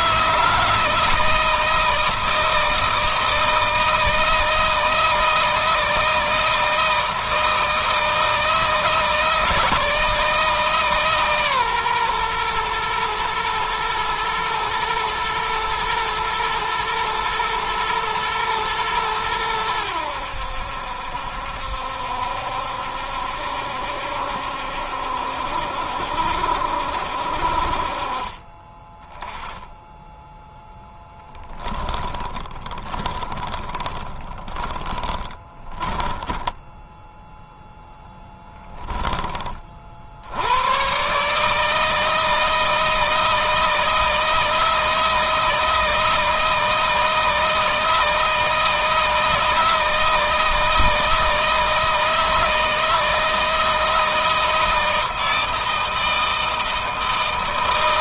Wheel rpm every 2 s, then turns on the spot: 160, 160, 160, 160, 160, 150, 110, 120, 110, 110, 70, 70, 70, 60, 20, 10, 30, 20, 0, 20, 130, 160, 160, 160, 160, 160, 160, 160, 160.
30-36